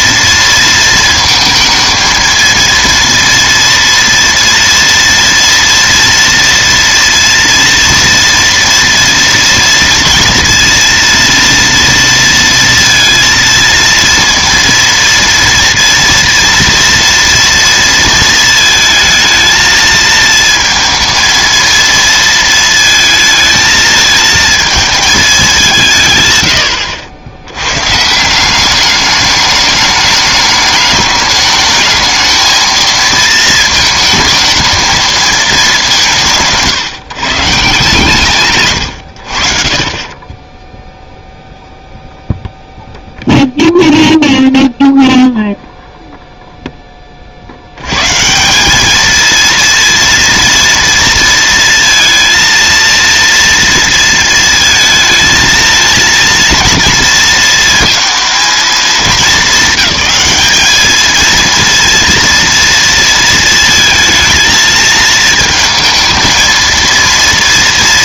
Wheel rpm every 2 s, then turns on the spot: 230, 230, 230, 230, 230, 230, 230, 230, 230, 220, 220, 230, 220, 110, 190, 210, 220, 220, 160, 130, 10, 0, 0, 0, 190, 230, 230, 230, 230, 220, 210, 230, 230, 230.
none